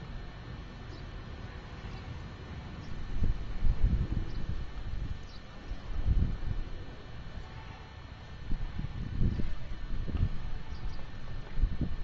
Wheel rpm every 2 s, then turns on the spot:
0, 0, 0, 0, 0, 0.
none